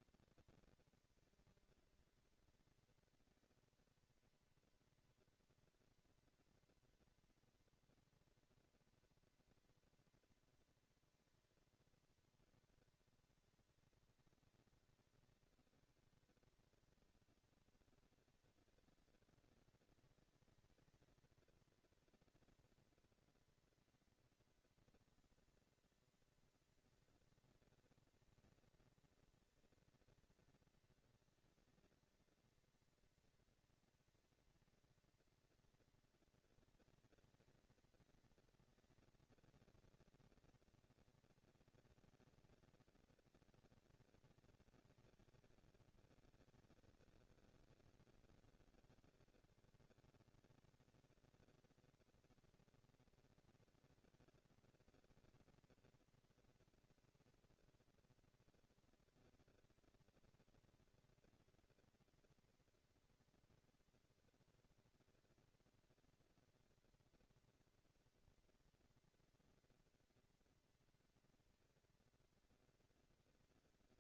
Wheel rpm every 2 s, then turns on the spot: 230, 230, 230, 230, 240, 230, 210, 190, 210, 230, 230, 230, 230, 230, 230, 230, 230, 230, 230, 230, 230, 230, 230, 210, 200, 210, 230, 230, 230, 230, 230, 230, 230, 230, 240, 230, 230.
none